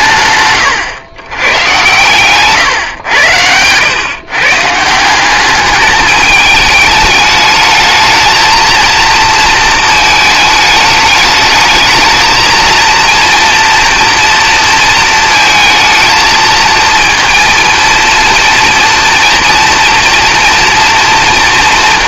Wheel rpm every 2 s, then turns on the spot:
110, 100, 200, 210, 230, 220, 230, 230, 230, 240, 230.
none